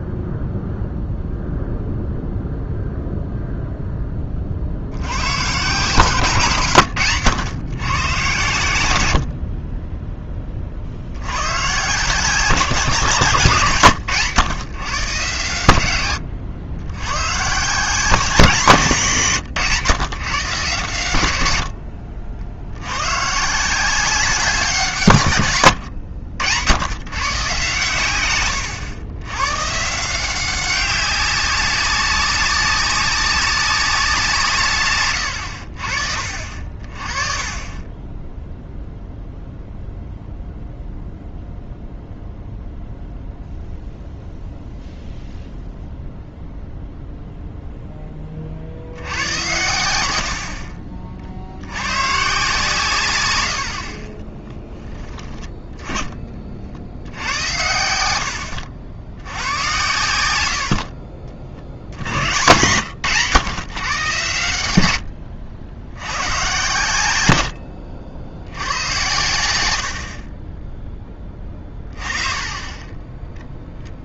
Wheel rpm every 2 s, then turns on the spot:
0, 0, 60, 140, 120, 40, 170, 140, 90, 180, 120, 70, 180, 90, 110, 190, 200, 140, 40, 0, 0, 0, 0, 0, 50, 60, 150, 20, 60, 70, 60, 110, 90, 120, 90, 10, 20.
6-8 54-56